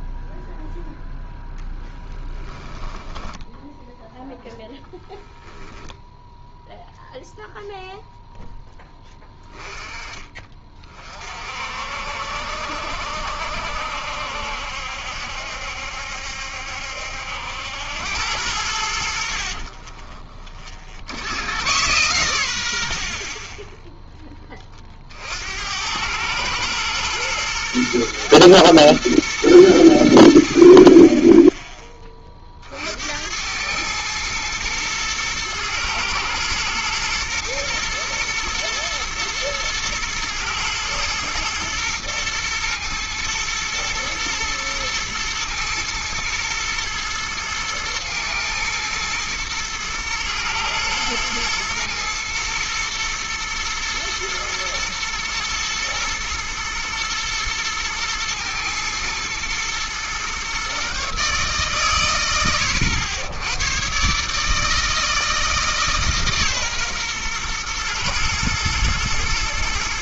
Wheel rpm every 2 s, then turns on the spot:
0, 10, 0, 0, 10, 40, 60, 70, 70, 80, 50, 70, 30, 110, 110, 30, 60, 120, 110, 120, 110, 110, 110, 110, 110, 110, 110, 120, 120, 110, 130, 90, 160, 130, 120.
2-4